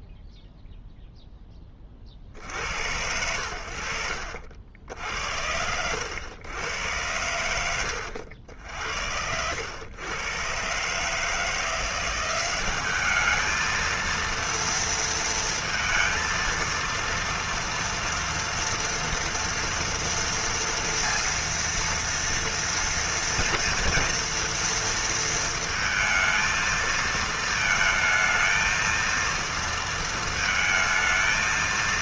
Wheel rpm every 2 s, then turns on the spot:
0, 80, 60, 110, 70, 140, 200, 230, 230, 230, 230, 230, 230, 220, 230, 220.
8-10